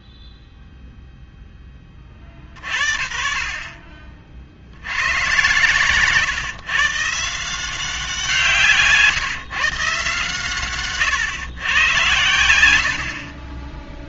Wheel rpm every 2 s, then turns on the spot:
0, 50, 80, 140, 150, 130, 80.
none